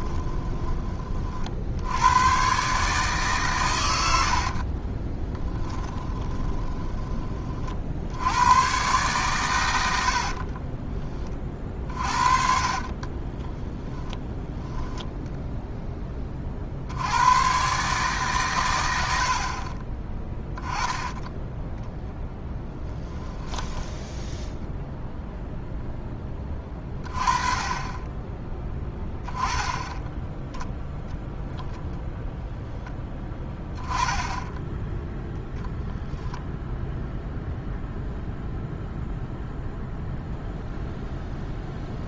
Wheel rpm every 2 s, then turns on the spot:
20, 140, 50, 20, 120, 30, 50, 10, 60, 110, 10, 10, 0, 20, 10, 0, 10, 10, 0, 0, 0.
4-8 10-14